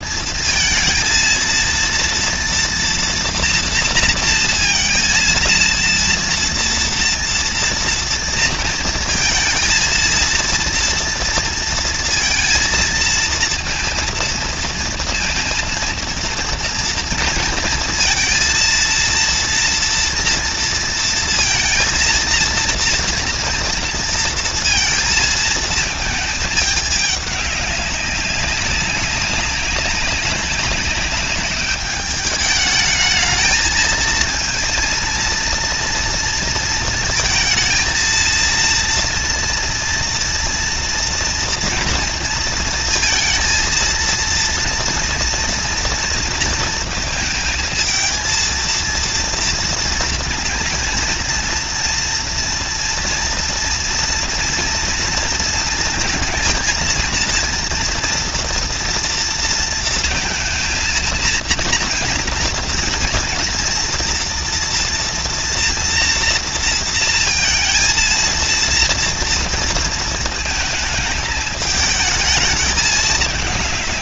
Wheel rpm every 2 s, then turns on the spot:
230, 230, 230, 230, 230, 230, 230, 230, 230, 230, 230, 230, 230, 210, 200, 200, 210, 230, 230, 230, 230, 230, 230, 230, 230, 240, 230, 230, 230, 230, 230, 230, 240, 230, 230, 220, 210.
none